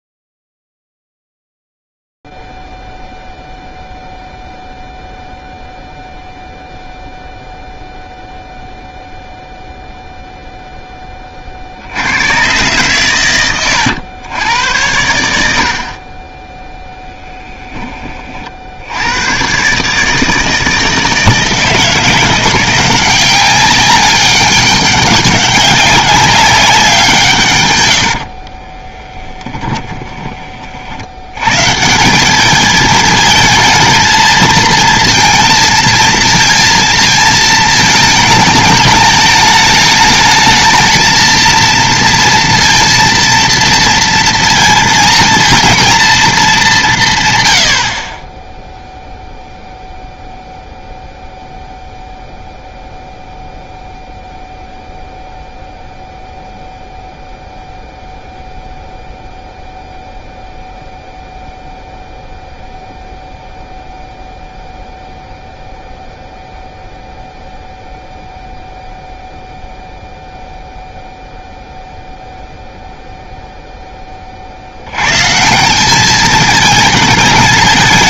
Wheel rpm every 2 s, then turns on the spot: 0, 0, 0, 0, 0, 0, 110, 100, 0, 50, 160, 180, 200, 200, 40, 30, 210, 230, 230, 220, 220, 230, 230, 210, 10, 0, 0, 0, 0, 0, 0, 0, 0, 0, 0, 0, 0, 60, 220.
28-30